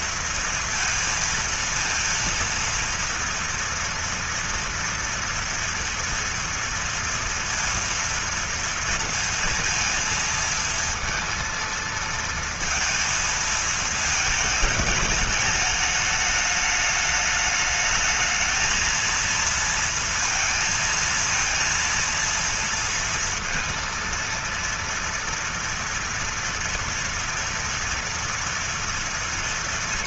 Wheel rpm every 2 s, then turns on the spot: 230, 230, 230, 230, 230, 230, 230, 220, 210, 220, 230, 230, 230, 230, 230.
none